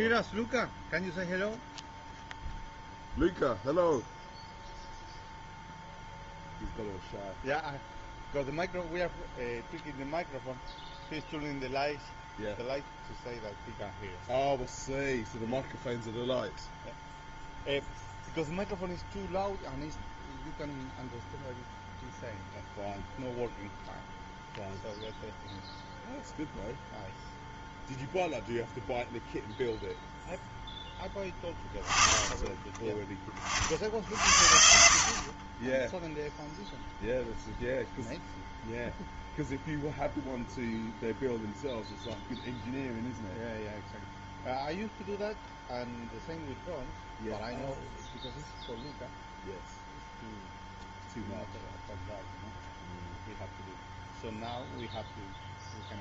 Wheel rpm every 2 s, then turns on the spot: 0, 0, 0, 0, 0, 0, 0, 0, 0, 0, 0, 0, 0, 0, 0, 0, 20, 60, 0, 0, 0, 0, 0, 0, 0, 0, 0, 0.
none